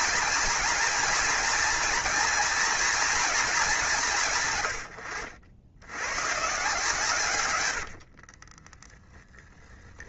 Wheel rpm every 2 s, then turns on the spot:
240, 230, 100, 140, 10.
8-10